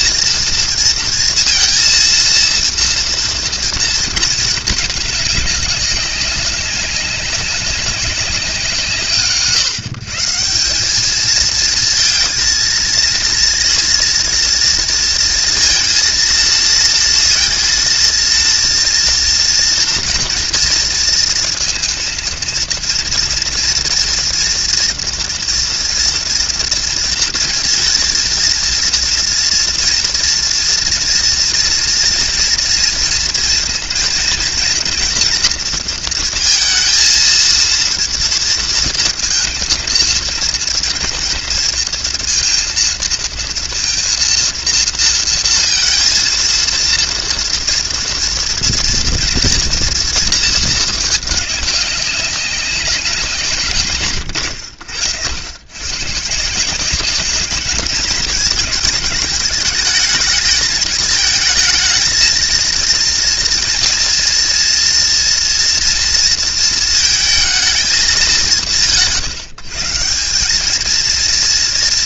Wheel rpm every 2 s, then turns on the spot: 230, 230, 210, 190, 180, 190, 230, 230, 230, 230, 230, 230, 230, 230, 230, 230, 240, 230, 230, 230, 230, 230, 230, 230, 240, 220, 200, 100, 170, 220, 220, 230, 230, 230, 160, 210.
none